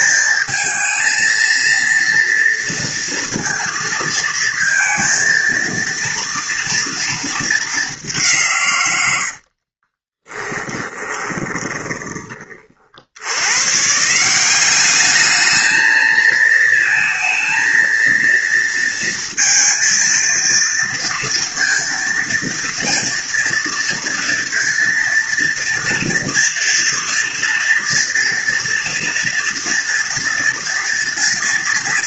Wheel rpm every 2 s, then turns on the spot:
220, 230, 230, 230, 150, 20, 30, 180, 220, 230, 230, 230, 230, 230, 230, 230.
10-12